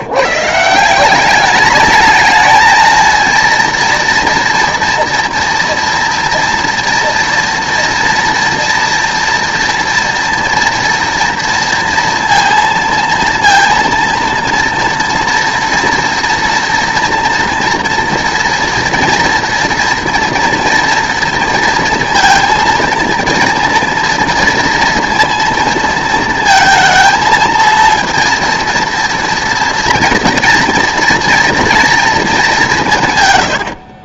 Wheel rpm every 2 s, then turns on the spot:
160, 220, 230, 230, 230, 230, 230, 230, 230, 230, 230, 230, 230, 220, 230, 230, 150.
none